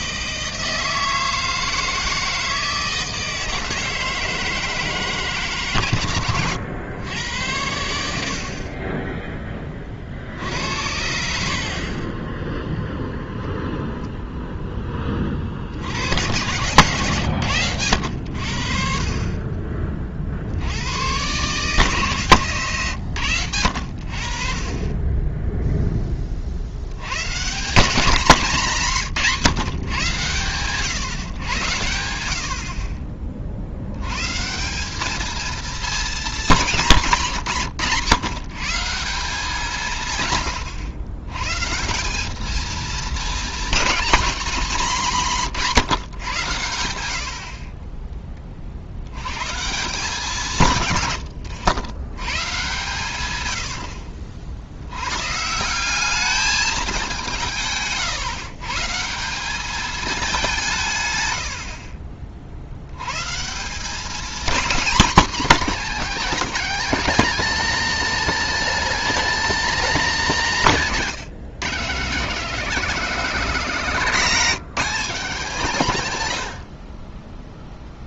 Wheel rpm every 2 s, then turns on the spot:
160, 160, 160, 110, 30, 60, 0, 10, 120, 50, 80, 120, 40, 70, 190, 130, 50, 180, 190, 140, 130, 220, 230, 100, 60, 130, 120, 80, 210, 140, 160, 70, 230, 230, 260, 200, 240, 210, 70.
none